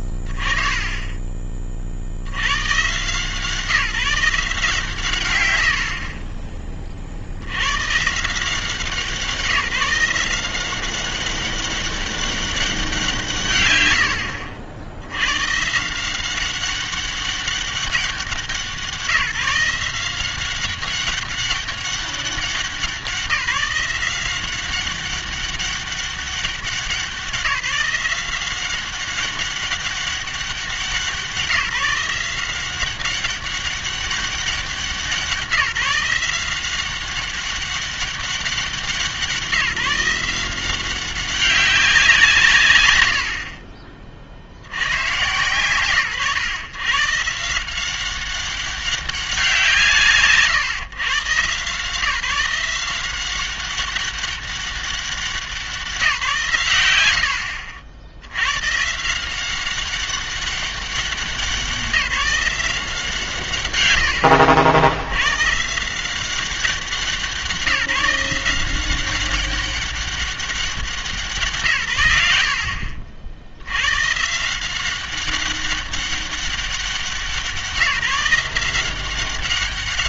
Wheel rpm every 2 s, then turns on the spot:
30, 60, 160, 70, 150, 180, 200, 120, 170, 190, 180, 190, 190, 190, 180, 190, 190, 180, 180, 190, 180, 140, 80, 130, 190, 140, 180, 190, 110, 130, 200, 180, 70, 190, 180, 190, 80, 170, 190, 180.
6-8